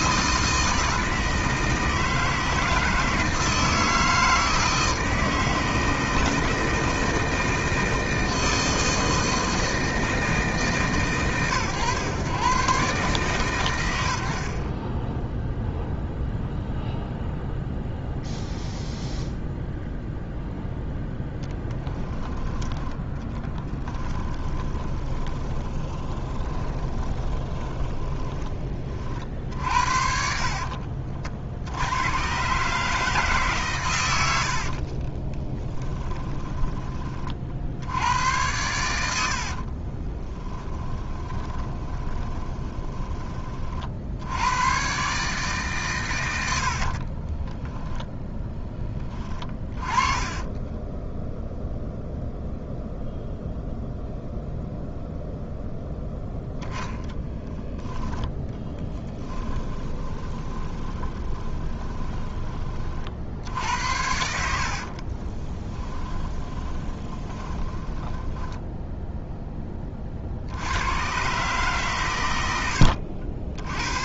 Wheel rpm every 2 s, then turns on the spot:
160, 160, 160, 160, 160, 150, 130, 30, 0, 0, 0, 10, 20, 20, 30, 40, 150, 40, 30, 90, 10, 10, 130, 60, 10, 10, 0, 0, 0, 10, 20, 40, 50, 20, 10, 90, 80.
14-16 24-28 34-36 40-42 46-48 50-52 58-62 64-68 72-74